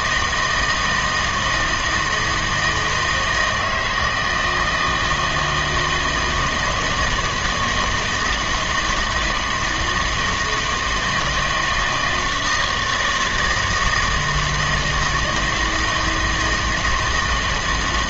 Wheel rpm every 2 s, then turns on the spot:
160, 160, 160, 160, 160, 160, 160, 160, 160.
none